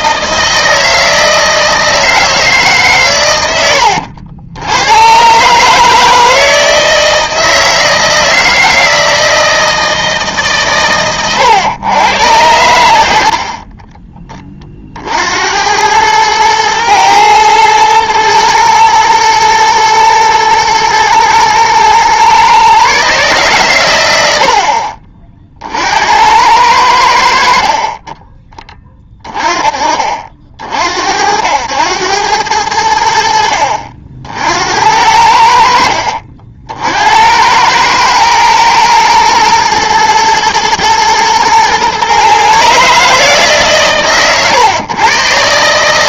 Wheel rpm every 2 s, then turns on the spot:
160, 150, 90, 160, 160, 140, 90, 30, 110, 120, 110, 130, 50, 90, 20, 60, 90, 70, 60, 110, 120, 140, 130.
none